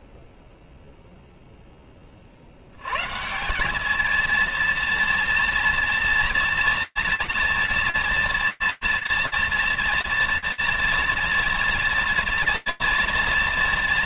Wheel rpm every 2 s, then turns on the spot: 0, 110, 230, 240, 230, 230, 230.
none